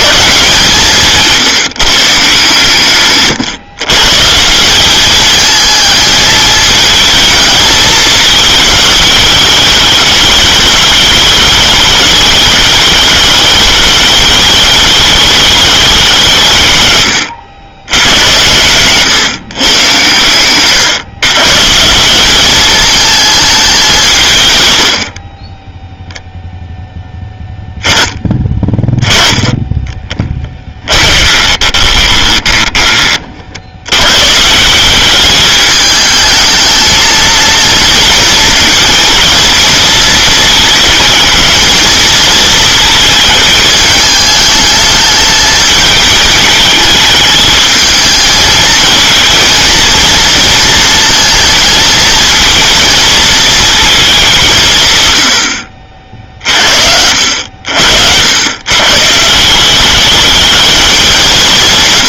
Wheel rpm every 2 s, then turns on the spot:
160, 130, 220, 220, 210, 210, 210, 200, 90, 120, 160, 200, 10, 10, 20, 20, 40, 200, 220, 230, 220, 220, 220, 220, 220, 230, 220, 100, 70, 140, 180.
28-32